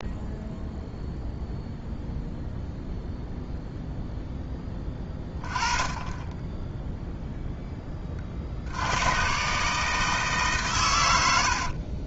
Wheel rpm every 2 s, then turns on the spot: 0, 0, 20, 20, 150, 60.
10-12